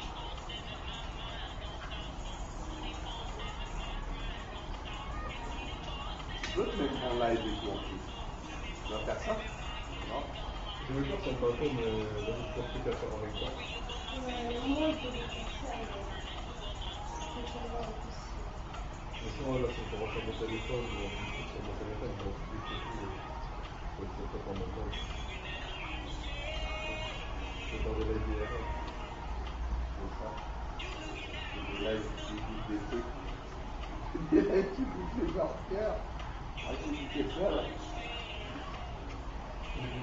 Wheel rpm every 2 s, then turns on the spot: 0, 0, 0, 0, 0, 0, 0, 0, 0, 0, 0, 0, 0, 0, 0, 0, 0, 0, 0, 0.
none